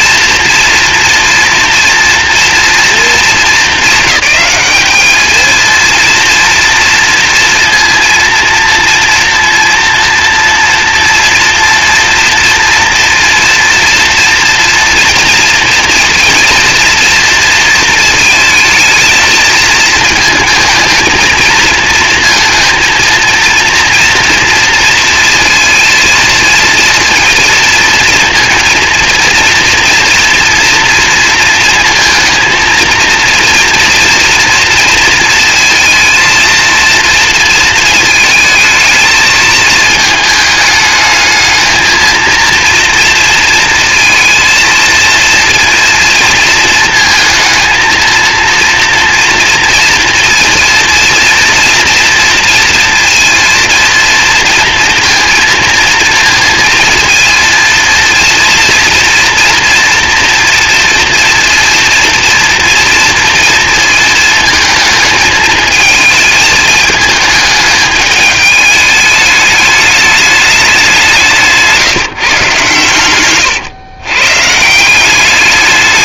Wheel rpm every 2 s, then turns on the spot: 230, 230, 210, 230, 230, 230, 240, 230, 230, 220, 220, 230, 230, 230, 230, 230, 230, 230, 230, 220, 220, 230, 230, 230, 230, 230, 230, 230, 230, 230, 240, 230, 220, 220, 210, 200, 140, 180.
none